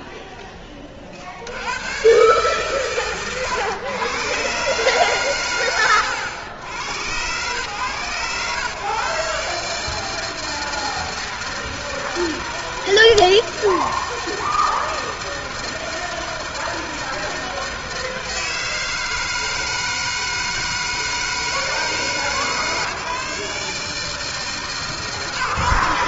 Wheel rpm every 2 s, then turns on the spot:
70, 110, 120, 120, 150, 160, 160, 160, 160, 160, 160, 150, 150.
none